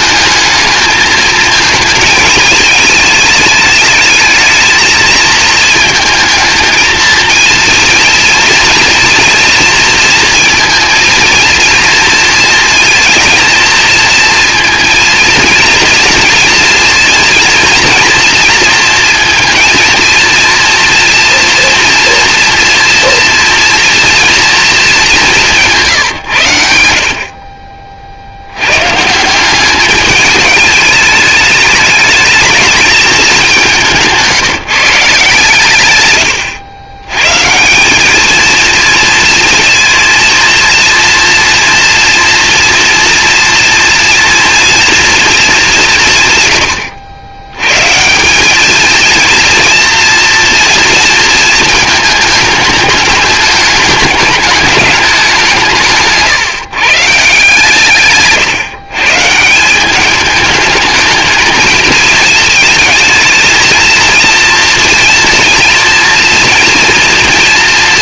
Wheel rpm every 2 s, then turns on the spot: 220, 220, 220, 230, 230, 230, 230, 230, 230, 230, 230, 240, 220, 80, 140, 210, 210, 160, 110, 230, 230, 230, 230, 100, 220, 230, 210, 210, 160, 140, 220, 220, 230, 230.
none